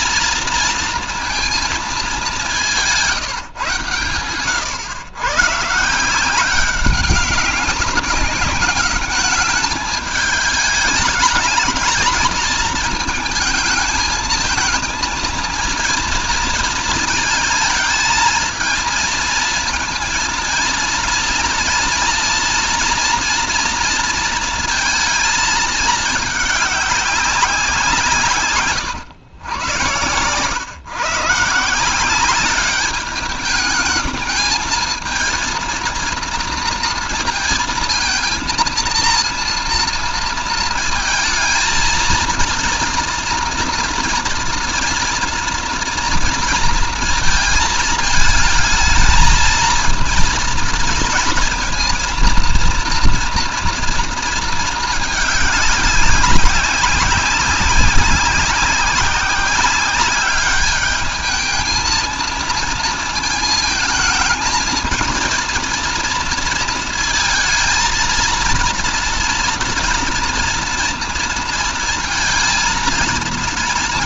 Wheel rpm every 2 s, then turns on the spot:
230, 150, 120, 200, 200, 210, 220, 230, 220, 220, 230, 230, 220, 190, 100, 130, 200, 220, 230, 230, 220, 230, 230, 230, 220, 230, 230, 210, 190, 190, 210, 230, 230, 230, 230, 230, 220.
none